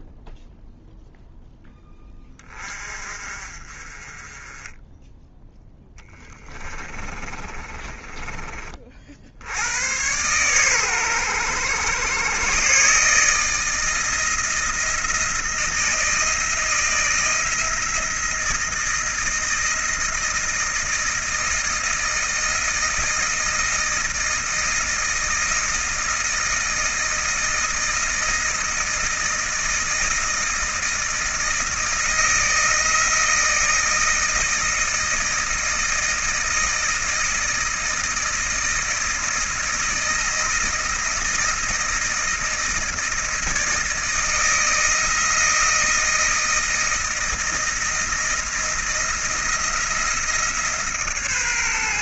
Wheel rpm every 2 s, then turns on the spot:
0, 40, 10, 30, 50, 120, 140, 170, 170, 160, 160, 160, 160, 160, 160, 160, 160, 160, 160, 160, 160, 160, 160, 160, 170, 150.
6-8